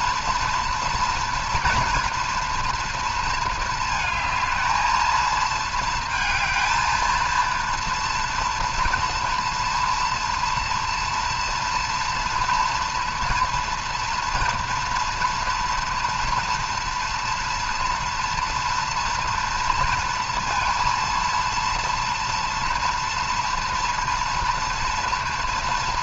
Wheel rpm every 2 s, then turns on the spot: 230, 230, 220, 220, 230, 230, 230, 230, 230, 230, 230, 230, 230.
none